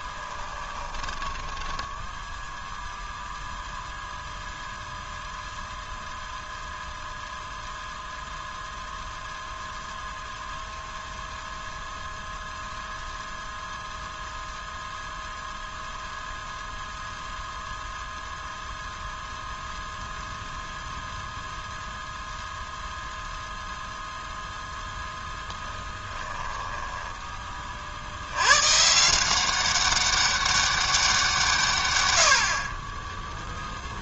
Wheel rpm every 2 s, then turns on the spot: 20, 0, 0, 0, 0, 0, 0, 0, 0, 0, 0, 0, 0, 10, 130, 200, 40.
0-2 26-28